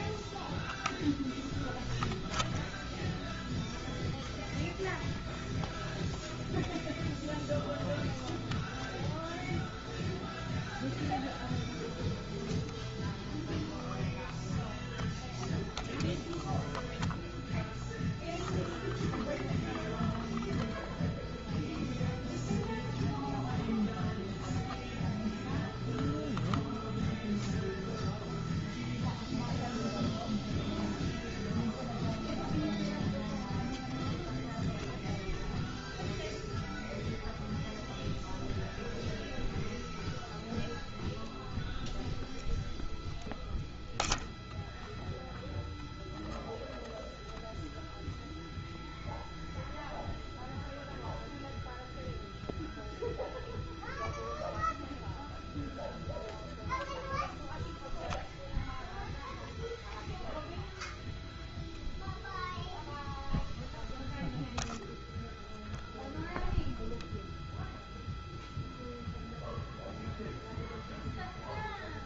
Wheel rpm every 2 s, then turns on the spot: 0, 0, 0, 0, 0, 0, 0, 0, 0, 0, 0, 0, 0, 0, 0, 0, 0, 0, 0, 0, 0, 0, 0, 0, 0, 0, 0, 0, 0, 0, 0, 0, 0, 0, 0, 0.
none